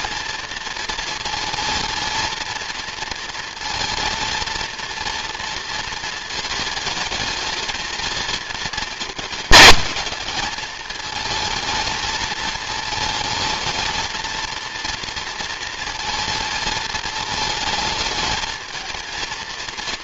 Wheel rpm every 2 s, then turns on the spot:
230, 230, 230, 220, 220, 220, 230, 230, 220, 220.
none